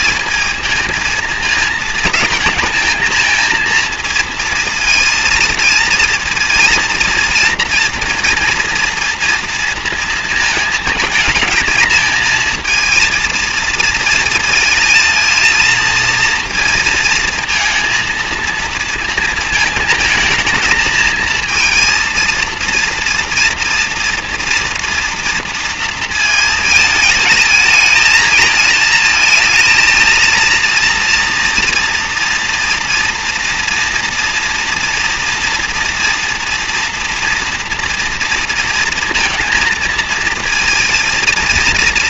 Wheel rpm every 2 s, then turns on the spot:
230, 220, 230, 230, 230, 220, 230, 230, 230, 230, 230, 230, 230, 220, 220, 230, 230, 230, 230, 230, 230.
none